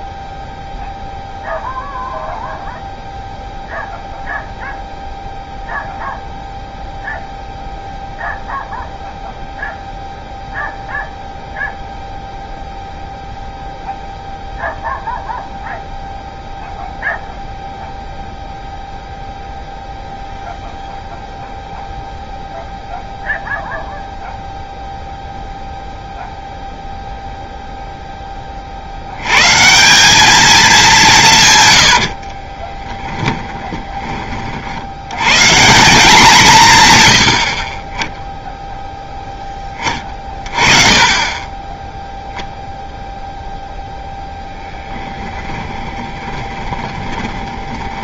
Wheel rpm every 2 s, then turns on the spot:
0, 0, 0, 0, 0, 0, 0, 0, 0, 0, 0, 0, 0, 0, 40, 210, 30, 50, 150, 0, 30, 0, 0, 20.
32-34 46-48